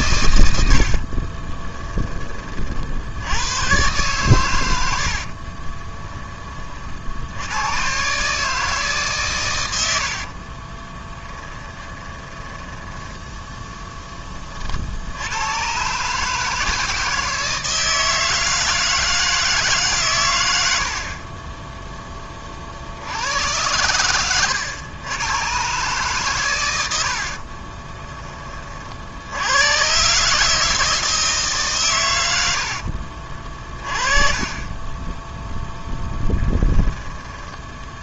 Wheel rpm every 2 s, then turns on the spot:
70, 60, 100, 50, 150, 20, 10, 60, 160, 160, 60, 70, 100, 90, 60, 160, 60, 20, 10.
0-2 4-6 10-14 32-34 36-38